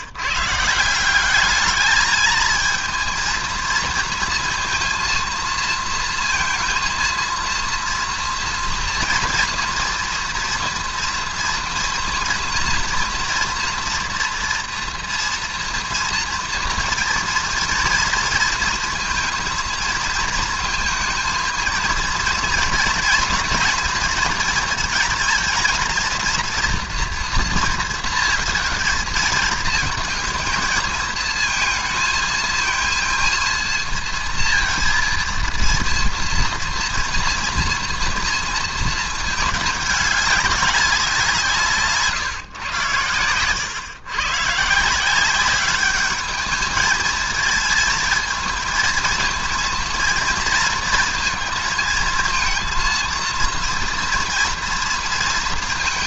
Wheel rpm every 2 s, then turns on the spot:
150, 220, 230, 230, 230, 230, 230, 240, 230, 230, 230, 230, 230, 230, 220, 220, 230, 230, 230, 230, 200, 120, 140, 210, 230, 230, 230, 230.
none